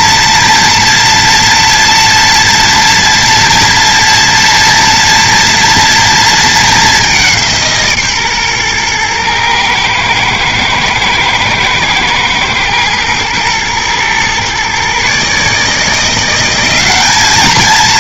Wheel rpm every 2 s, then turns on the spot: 230, 230, 230, 210, 120, 110, 120, 130, 200.
none